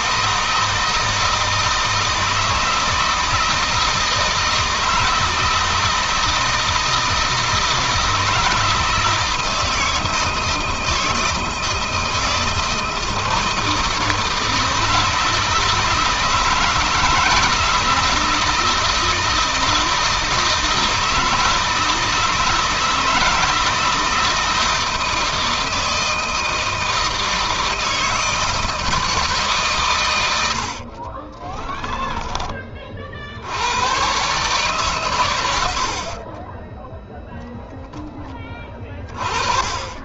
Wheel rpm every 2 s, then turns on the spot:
160, 160, 160, 160, 160, 160, 160, 160, 160, 160, 160, 160, 160, 160, 160, 50, 50, 130, 10, 30.
30-32